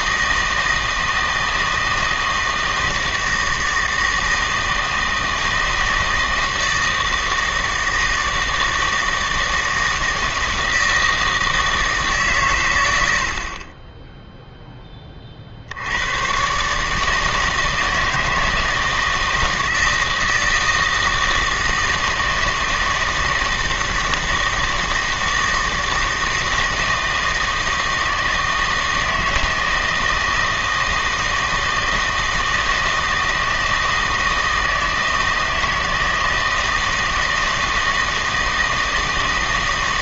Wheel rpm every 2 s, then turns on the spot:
160, 160, 160, 160, 160, 160, 110, 10, 140, 160, 160, 160, 160, 160, 160, 160, 160, 160, 160, 160.
none